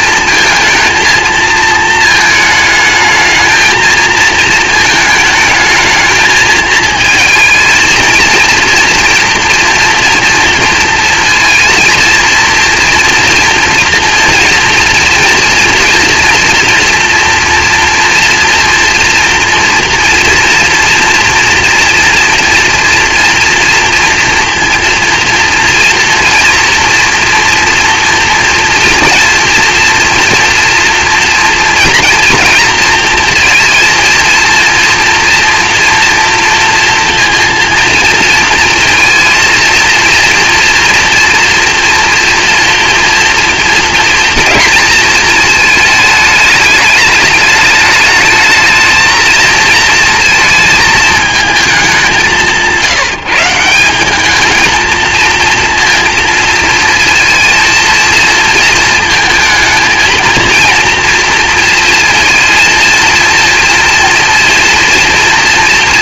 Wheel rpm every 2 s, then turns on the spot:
230, 220, 230, 230, 230, 230, 230, 230, 240, 230, 240, 230, 230, 230, 230, 230, 230, 230, 230, 230, 230, 230, 230, 210, 220, 220, 170, 220, 220, 220, 230, 230, 230.
none